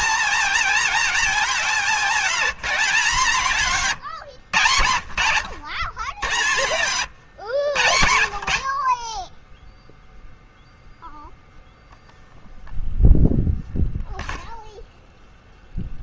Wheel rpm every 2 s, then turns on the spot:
230, 200, 100, 130, 40, 0, 0, 0.
none